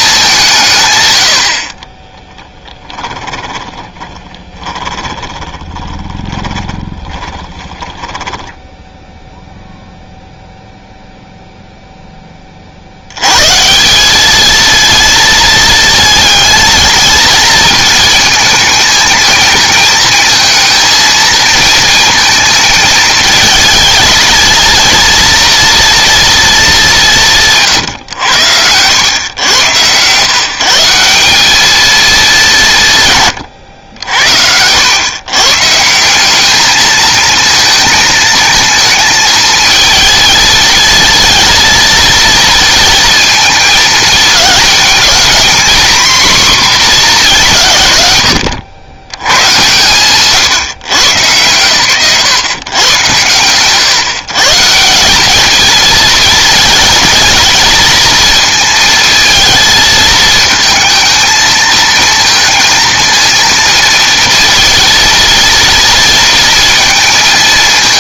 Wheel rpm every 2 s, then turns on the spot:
160, 10, 20, 20, 10, 0, 50, 220, 230, 220, 220, 220, 230, 210, 90, 160, 160, 90, 210, 220, 230, 230, 220, 240, 110, 140, 120, 160, 220, 230, 220, 230, 230, 230.
2-10